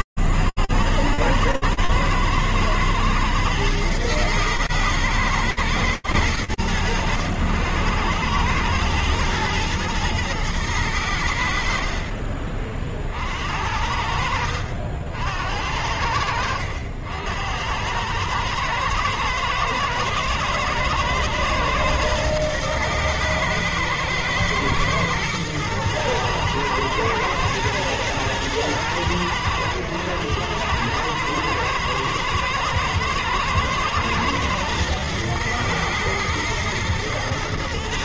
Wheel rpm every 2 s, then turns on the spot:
80, 110, 120, 100, 100, 110, 60, 70, 80, 110, 110, 110, 110, 110, 110, 110, 110, 120, 110.
none